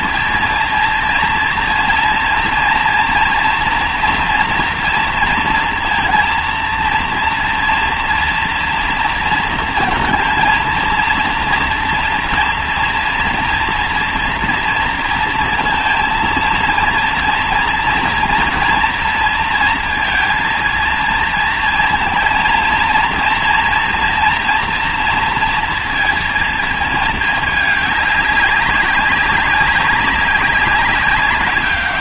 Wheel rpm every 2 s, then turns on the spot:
230, 230, 230, 230, 230, 230, 230, 230, 230, 230, 230, 230, 240, 220, 190, 190.
none